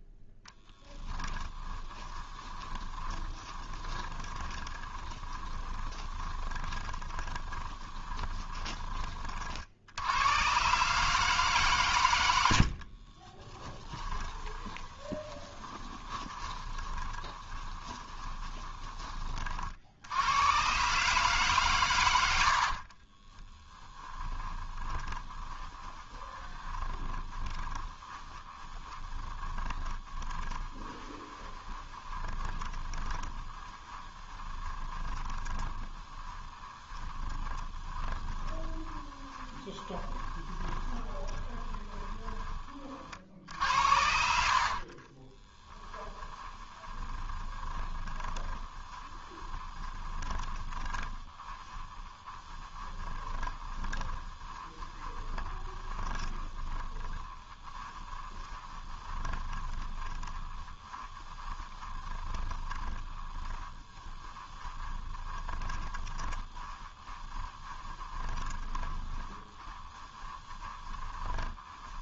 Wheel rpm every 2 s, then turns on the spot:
10, 20, 20, 20, 20, 130, 60, 20, 20, 20, 130, 40, 20, 20, 20, 20, 20, 20, 30, 20, 20, 40, 60, 20, 20, 20, 20, 20, 20, 20, 20, 20, 20, 20, 20, 20.
0-8 12-20 22-42 44-72